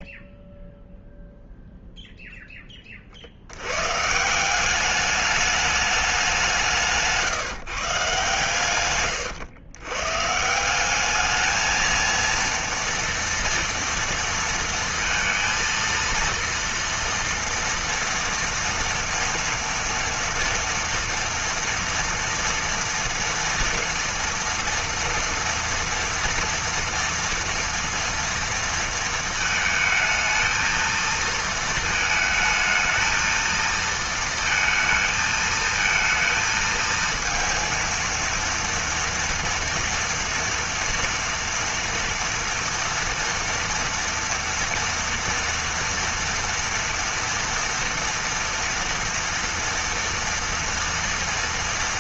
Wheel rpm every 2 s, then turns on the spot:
0, 40, 200, 160, 120, 200, 230, 230, 230, 230, 230, 230, 230, 230, 230, 220, 220, 220, 230, 230, 230, 230, 230, 230, 230, 230.
none